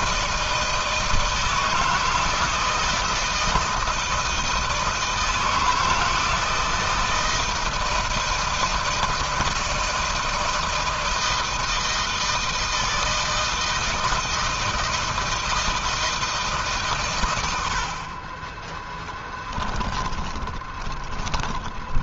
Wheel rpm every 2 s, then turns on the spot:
160, 160, 160, 160, 160, 160, 160, 160, 150, 20, 30.
18-22